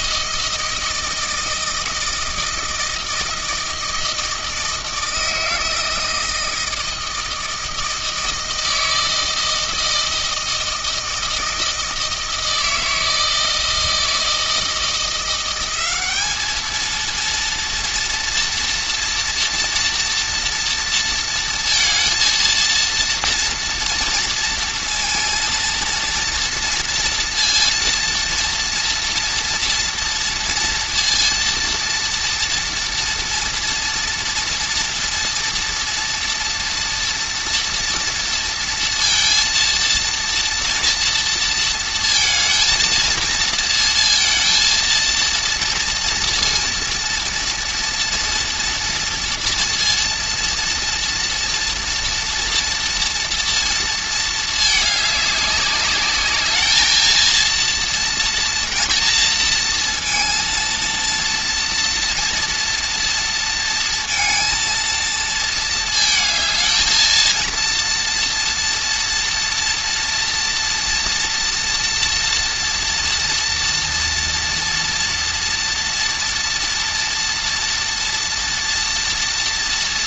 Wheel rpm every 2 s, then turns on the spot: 160, 160, 160, 160, 160, 160, 160, 170, 220, 230, 230, 230, 230, 230, 230, 230, 230, 230, 240, 230, 230, 230, 230, 230, 230, 230, 240, 210, 220, 230, 230, 230, 230, 220, 230, 240, 230, 230, 230, 230.
none